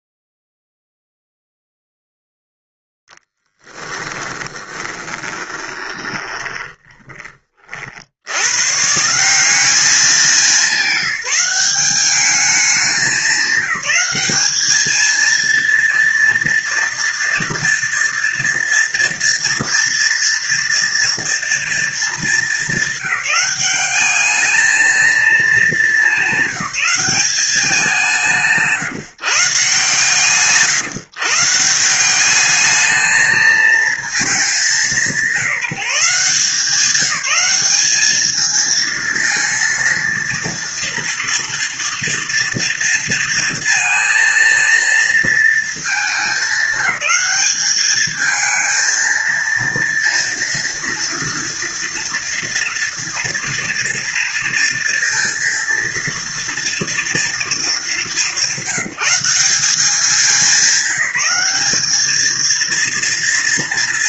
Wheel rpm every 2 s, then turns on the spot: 0, 0, 10, 20, 110, 200, 200, 200, 230, 240, 230, 210, 210, 210, 170, 150, 200, 210, 170, 220, 230, 230, 230, 200, 220, 230, 230, 230, 230, 180, 190, 220.
4-8